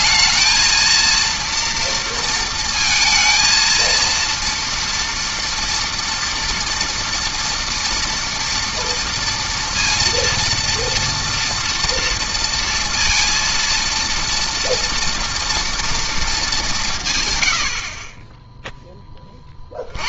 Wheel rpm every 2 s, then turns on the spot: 230, 230, 230, 240, 230, 230, 230, 220, 10, 150.
none